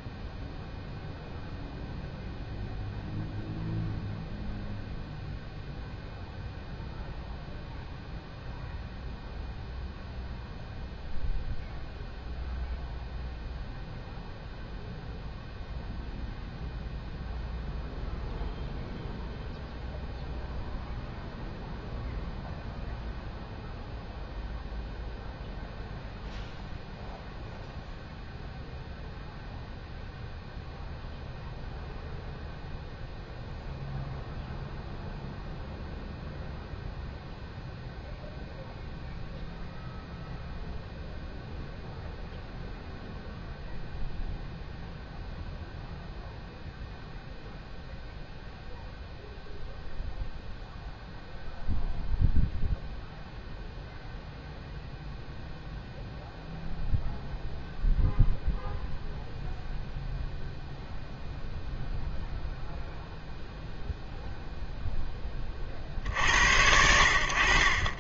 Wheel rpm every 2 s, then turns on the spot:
0, 0, 0, 0, 0, 0, 0, 0, 0, 0, 0, 0, 0, 0, 0, 0, 0, 0, 0, 0, 0, 0, 0, 0, 0, 0, 0, 0, 0, 0, 0, 0, 0, 70.
none